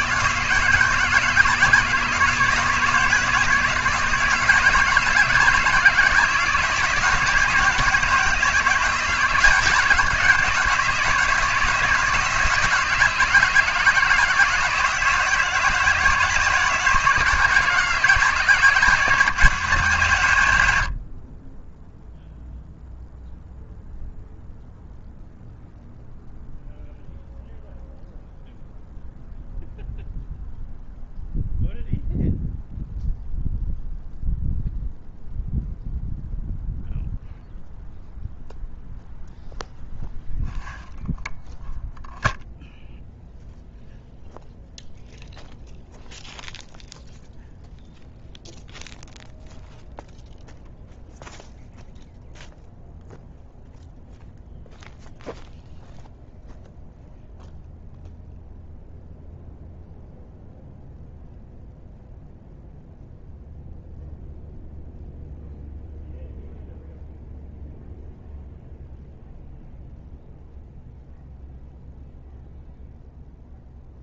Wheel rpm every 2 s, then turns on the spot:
160, 160, 170, 160, 160, 160, 160, 170, 160, 170, 90, 0, 0, 0, 0, 0, 0, 0, 0, 0, 0, 0, 0, 0, 0, 0, 0, 0, 0, 0, 0, 0, 0, 0, 0, 0, 0.
none